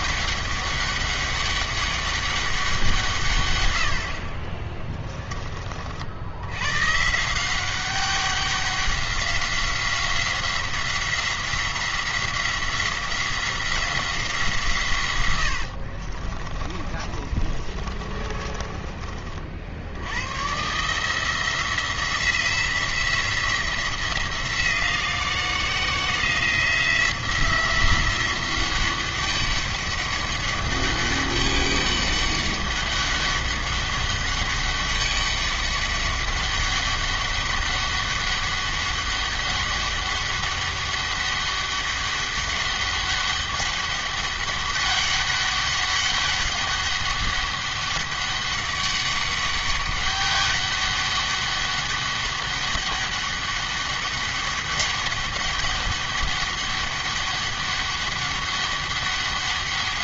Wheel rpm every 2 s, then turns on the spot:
200, 170, 20, 120, 190, 180, 180, 150, 40, 30, 140, 170, 170, 170, 190, 200, 200, 200, 200, 200, 200, 200, 200, 200, 200, 200, 200, 200, 200, 200.
16-20